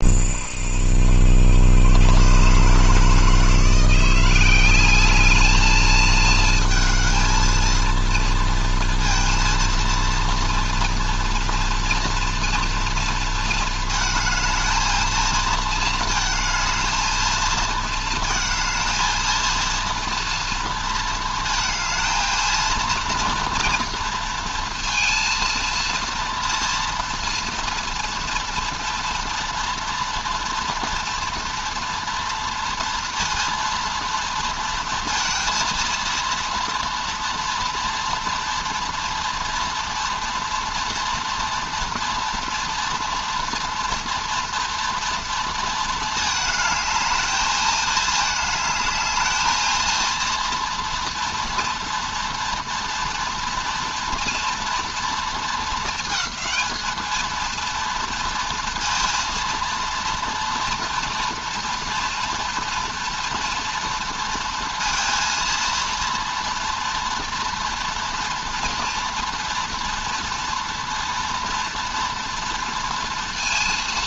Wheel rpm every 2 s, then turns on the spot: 90, 150, 200, 220, 230, 240, 230, 220, 220, 230, 230, 230, 230, 230, 230, 240, 230, 230, 230, 230, 230, 230, 230, 210, 220, 230, 230, 230, 220, 230, 240, 230, 230, 230, 240, 230, 230.
none